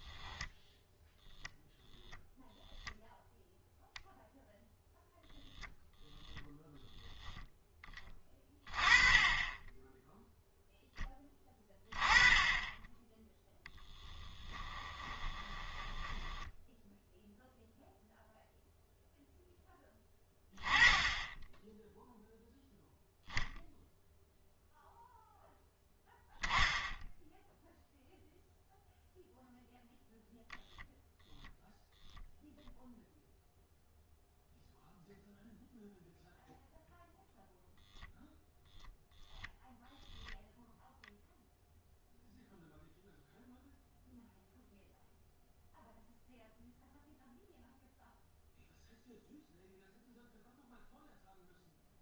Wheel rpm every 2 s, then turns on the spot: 0, 0, 0, 0, 20, 10, 20, 20, 10, 0, 10, 0, 0, 10, 0, 0, 0, 0, 0, 0, 0, 0, 0, 0, 0, 0.
14-16